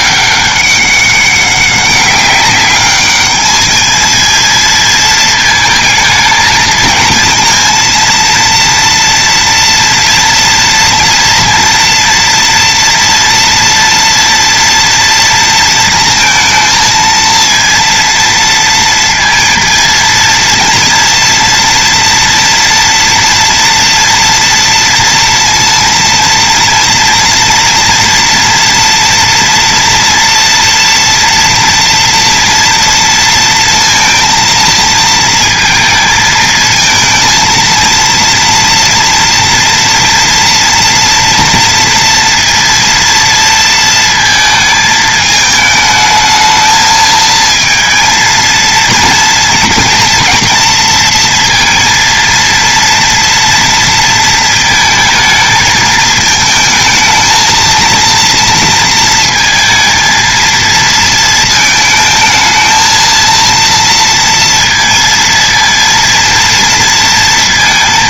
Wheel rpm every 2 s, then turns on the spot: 200, 200, 230, 220, 230, 230, 240, 230, 230, 230, 230, 230, 230, 230, 230, 240, 230, 230, 220, 230, 230, 230, 220, 220, 230, 230, 230, 230, 220, 230, 230, 220, 230, 230.
none